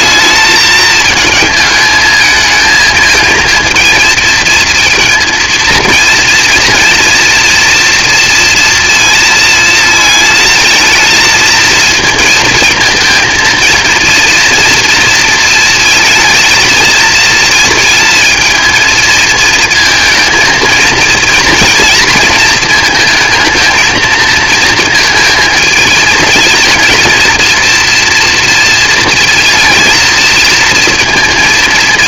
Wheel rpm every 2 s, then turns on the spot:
220, 230, 230, 230, 230, 220, 230, 240, 220, 230, 230, 230, 230, 230, 230, 230.
none